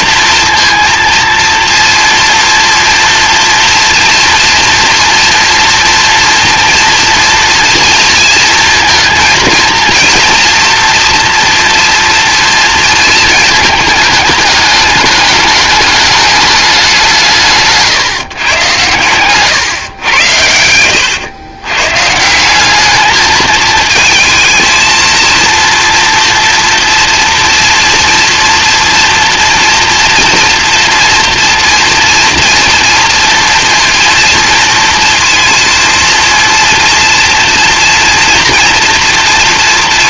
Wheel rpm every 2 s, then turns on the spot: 230, 230, 230, 230, 230, 230, 230, 210, 200, 120, 80, 200, 230, 230, 230, 230, 230, 230, 230, 230.
20-22